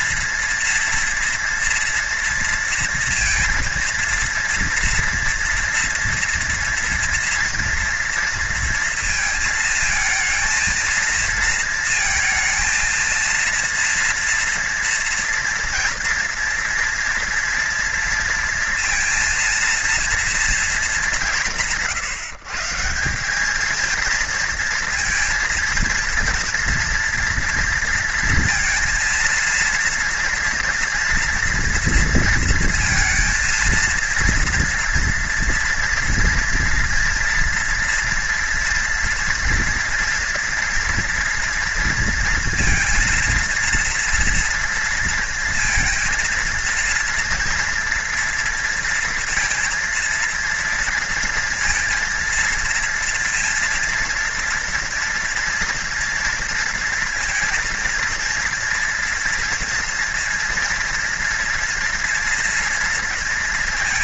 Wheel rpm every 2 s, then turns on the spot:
230, 230, 230, 230, 230, 230, 230, 230, 230, 230, 230, 160, 230, 230, 230, 230, 230, 230, 240, 240, 230, 230, 230, 230, 230, 230, 230, 230, 230, 230, 230, 230.
none